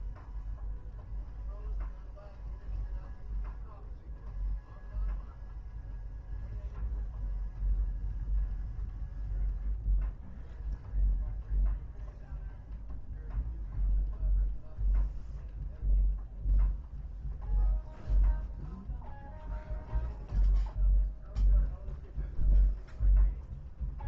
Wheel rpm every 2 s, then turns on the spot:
0, 0, 0, 0, 0, 0, 0, 0, 0, 0, 0, 0.
none